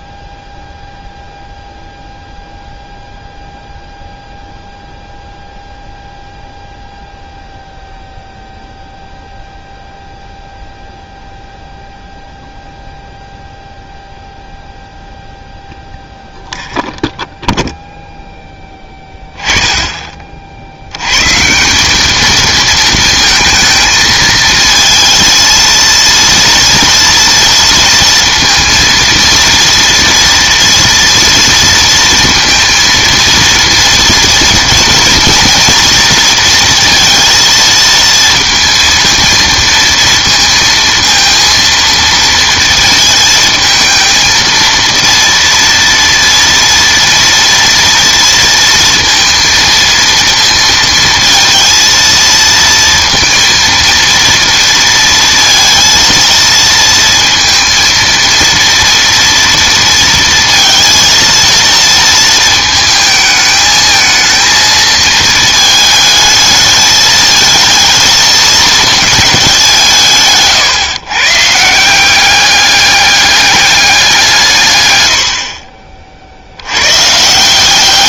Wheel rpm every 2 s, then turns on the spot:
0, 0, 0, 0, 0, 0, 0, 0, 0, 10, 70, 220, 230, 230, 230, 240, 230, 230, 230, 230, 230, 230, 230, 230, 230, 230, 230, 230, 230, 230, 230, 220, 220, 220, 220, 130, 200, 110, 90.
none